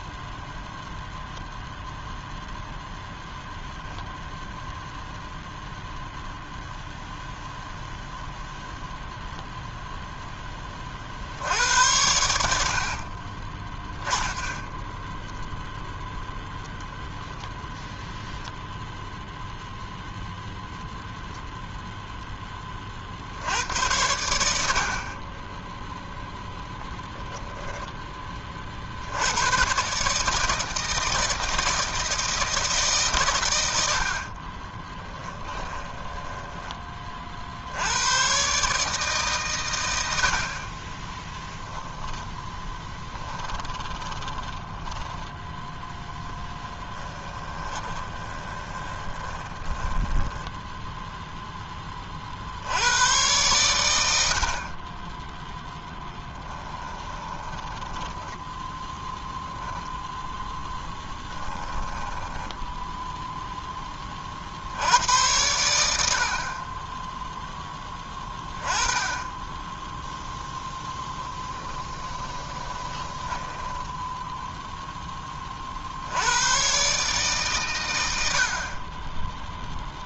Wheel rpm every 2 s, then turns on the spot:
0, 0, 0, 0, 0, 50, 50, 10, 10, 0, 0, 40, 50, 10, 60, 160, 150, 20, 20, 140, 20, 10, 10, 20, 20, 0, 90, 20, 20, 10, 10, 0, 80, 10, 20, 10, 20, 10, 130, 30.
34-36 42-50 56-58 60-62 70-74